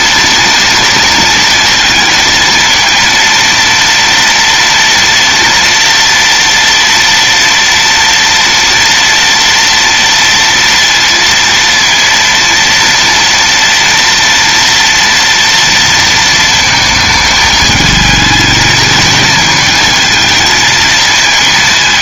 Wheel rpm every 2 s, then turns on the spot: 230, 230, 230, 230, 230, 230, 230, 230, 220, 220, 220.
none